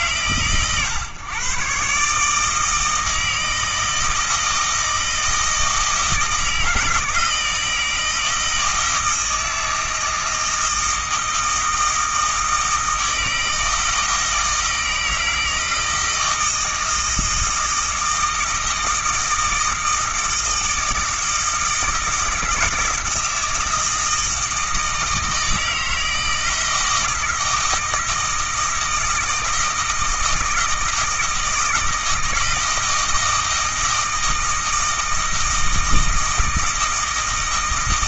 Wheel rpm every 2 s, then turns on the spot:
120, 160, 160, 160, 160, 160, 160, 160, 160, 160, 160, 160, 160, 160, 160, 160, 160, 160, 160.
none